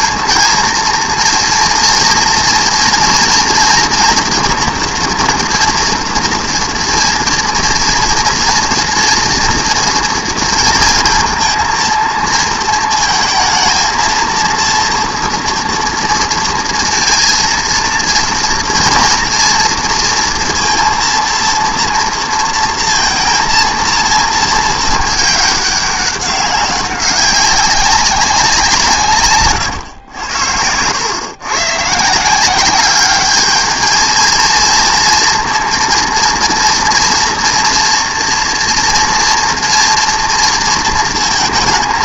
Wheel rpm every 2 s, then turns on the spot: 230, 240, 230, 230, 230, 230, 230, 230, 230, 240, 230, 230, 220, 190, 170, 90, 190, 230, 240, 230, 230.
none